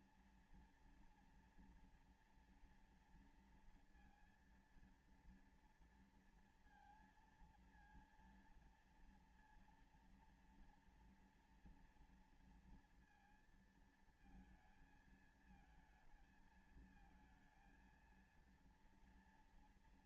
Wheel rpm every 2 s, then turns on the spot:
230, 230, 230, 230, 230, 230, 230, 220, 220, 230.
none